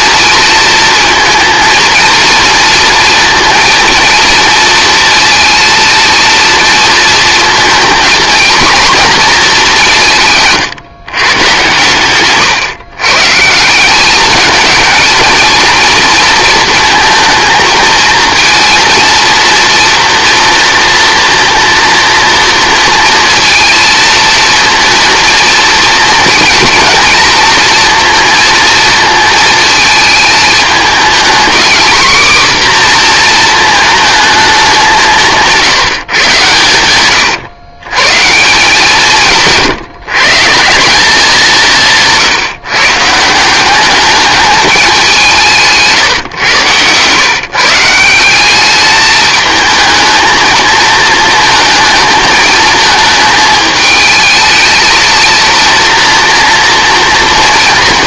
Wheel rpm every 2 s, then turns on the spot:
230, 230, 230, 230, 240, 140, 130, 220, 230, 230, 230, 230, 240, 230, 230, 220, 250, 210, 110, 180, 180, 150, 210, 120, 200, 230, 220, 220, 230.
none